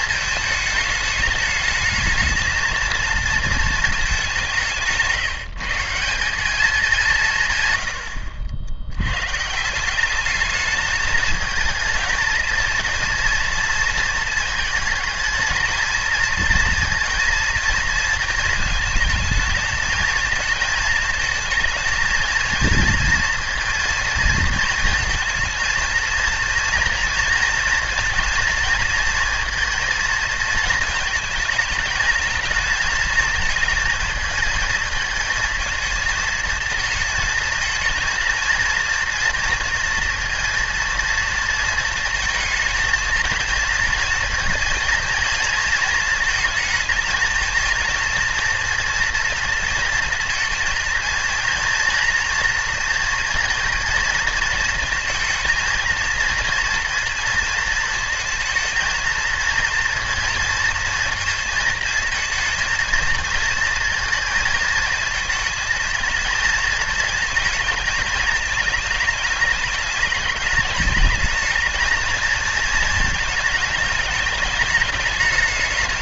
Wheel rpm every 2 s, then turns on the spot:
220, 220, 180, 200, 80, 210, 230, 220, 230, 220, 220, 230, 230, 230, 230, 230, 220, 220, 220, 230, 230, 230, 230, 220, 230, 230, 240, 230, 230, 230, 230, 220, 220, 220, 220, 220, 220, 210.
none